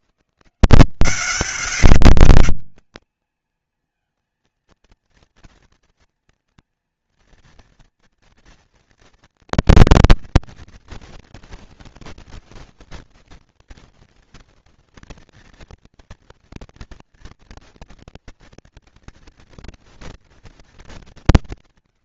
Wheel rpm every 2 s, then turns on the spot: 170, 200, 230, 240, 240, 230, 230, 230, 230, 230, 230.
none